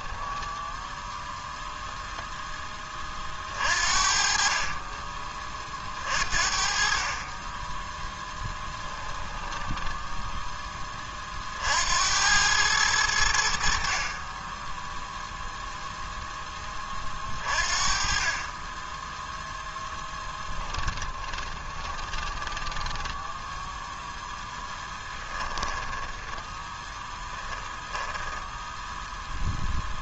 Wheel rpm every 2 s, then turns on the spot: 0, 20, 30, 40, 10, 20, 90, 0, 30, 10, 20, 10, 10, 10, 10.
8-10 20-28